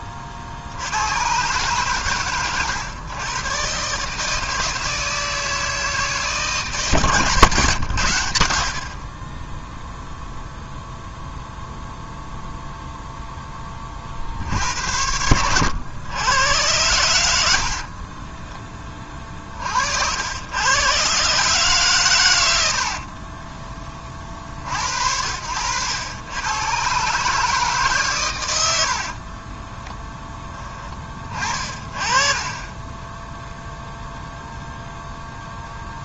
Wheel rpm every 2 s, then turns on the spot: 100, 120, 160, 150, 50, 0, 0, 90, 90, 30, 120, 50, 70, 130, 70, 20, 10, 0.
22-24 28-30